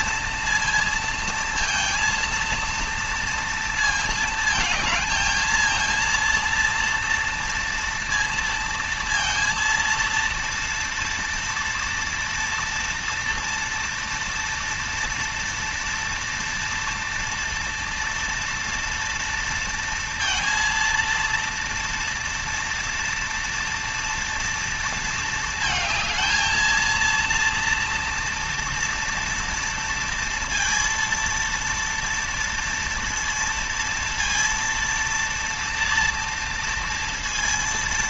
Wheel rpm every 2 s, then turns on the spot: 230, 230, 220, 230, 230, 230, 240, 230, 230, 230, 230, 230, 230, 220, 230, 230, 230, 230, 230.
none